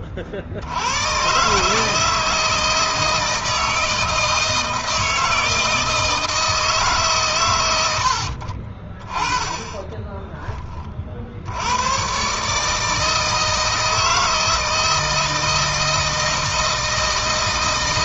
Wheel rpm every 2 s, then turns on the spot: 90, 160, 160, 150, 30, 30, 160, 160, 160.
none